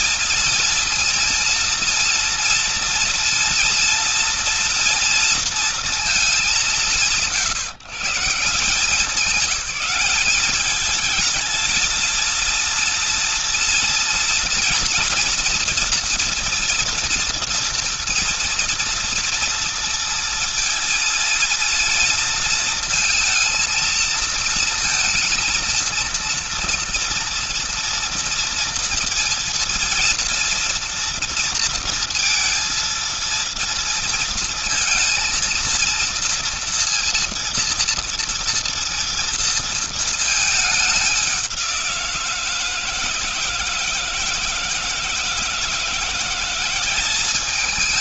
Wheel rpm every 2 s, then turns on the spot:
230, 230, 230, 140, 180, 220, 230, 230, 230, 230, 230, 220, 230, 230, 230, 230, 230, 230, 230, 230, 210, 160, 160, 180.
none